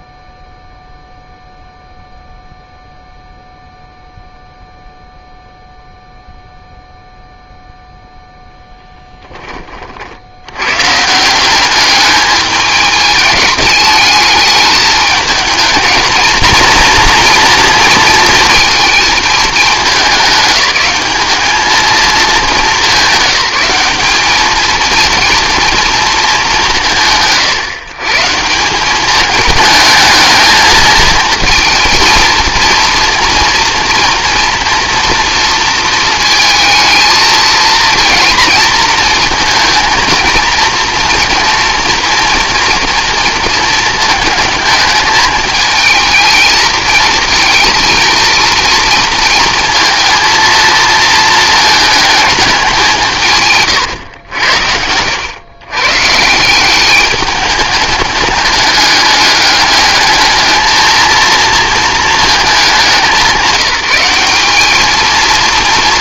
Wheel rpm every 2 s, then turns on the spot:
0, 0, 0, 0, 10, 130, 210, 210, 230, 220, 200, 200, 230, 180, 190, 220, 230, 230, 220, 220, 230, 230, 210, 220, 230, 230, 190, 80, 190, 210, 220, 200, 210.
none